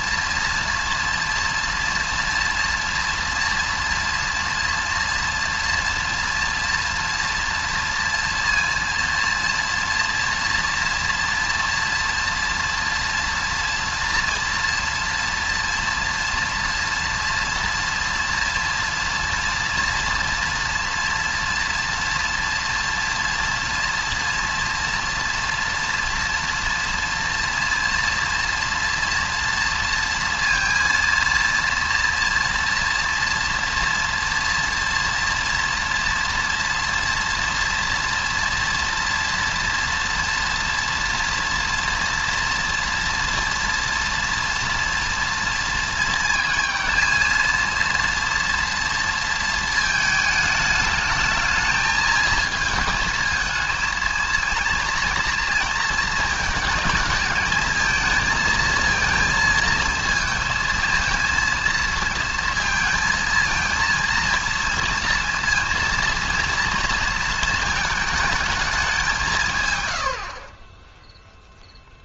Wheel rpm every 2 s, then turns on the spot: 230, 230, 230, 230, 230, 230, 230, 230, 230, 230, 230, 230, 230, 230, 230, 230, 230, 230, 230, 230, 230, 230, 230, 220, 230, 210, 220, 230, 220, 230, 220, 230, 230, 240, 210, 20.
none